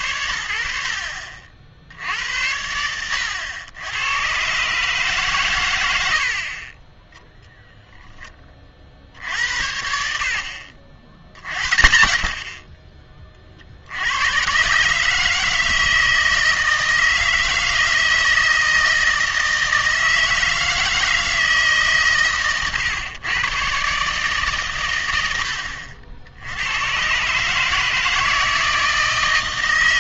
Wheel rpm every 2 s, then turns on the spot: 70, 90, 140, 30, 40, 50, 40, 130, 160, 160, 160, 130, 120, 90, 160.
none